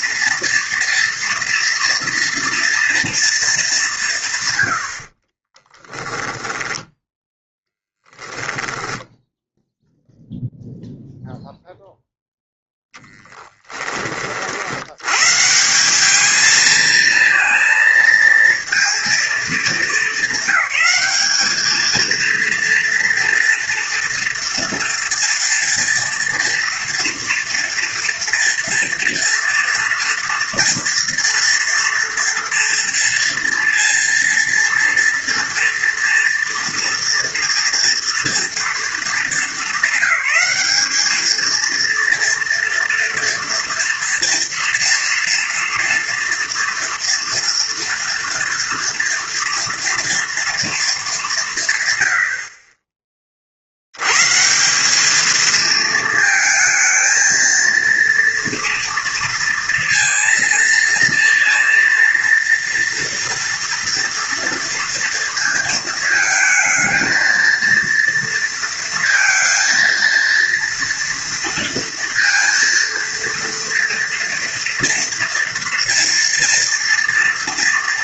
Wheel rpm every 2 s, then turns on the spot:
230, 240, 80, 10, 0, 0, 0, 80, 220, 230, 210, 230, 230, 230, 240, 230, 230, 230, 230, 220, 210, 230, 230, 240, 230, 220, 30, 190, 220, 230, 230, 230, 230, 220, 230, 230, 230, 230, 230.
4-6